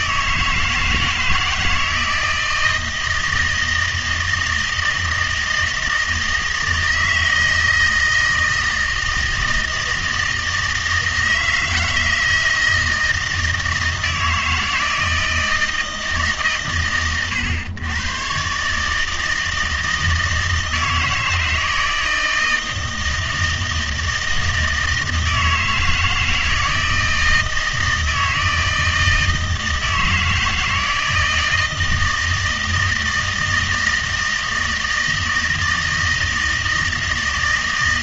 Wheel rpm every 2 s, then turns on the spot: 160, 160, 160, 160, 160, 160, 160, 160, 130, 140, 160, 160, 160, 160, 160, 160, 160, 160, 160.
none